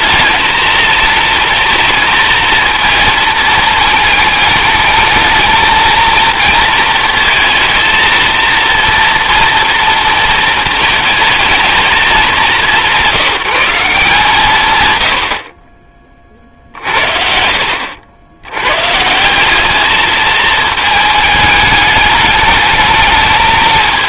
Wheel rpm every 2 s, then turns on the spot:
220, 230, 210, 230, 230, 220, 180, 150, 60, 110, 220, 220.
none